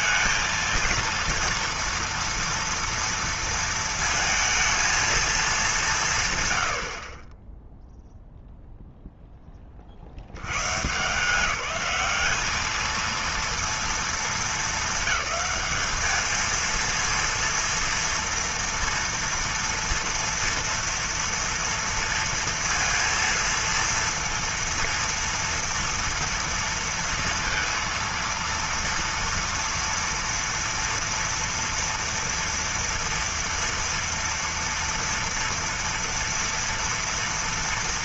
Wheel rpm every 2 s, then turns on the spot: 230, 230, 230, 70, 0, 140, 220, 220, 230, 230, 230, 230, 230, 230, 230, 240, 230, 230, 230.
none